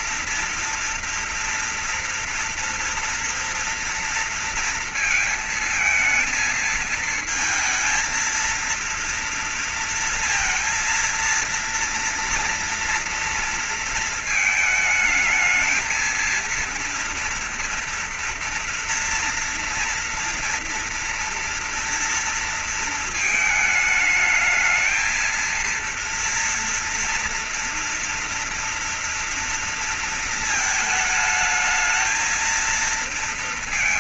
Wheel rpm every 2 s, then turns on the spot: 230, 230, 230, 220, 230, 230, 230, 220, 230, 230, 230, 230, 210, 230, 240, 230, 220.
none